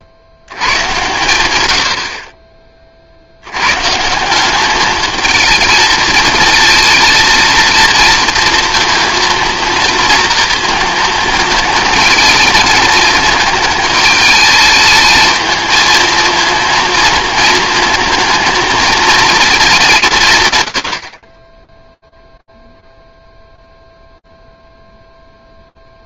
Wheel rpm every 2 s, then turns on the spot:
100, 30, 200, 230, 230, 230, 230, 220, 230, 220, 110, 0, 0.
none